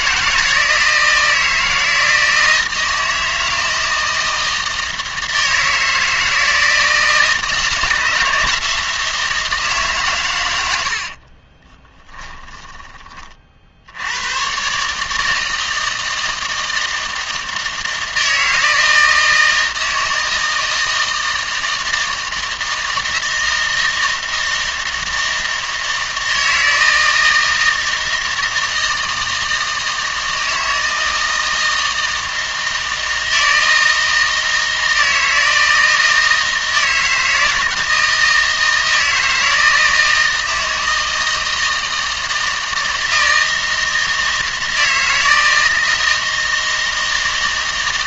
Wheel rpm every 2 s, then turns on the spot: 160, 160, 160, 160, 160, 90, 20, 130, 160, 160, 160, 160, 160, 160, 160, 160, 160, 160, 160, 160, 160, 160, 160, 160.
12-14